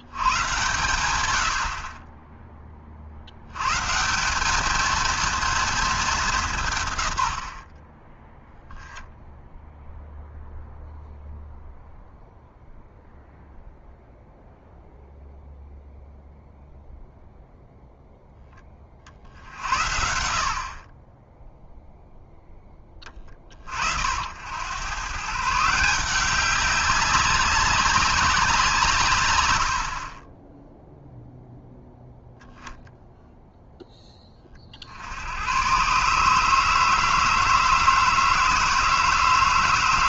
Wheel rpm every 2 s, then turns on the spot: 120, 30, 220, 140, 10, 0, 0, 0, 0, 10, 60, 10, 100, 190, 160, 0, 0, 50, 160, 160.
none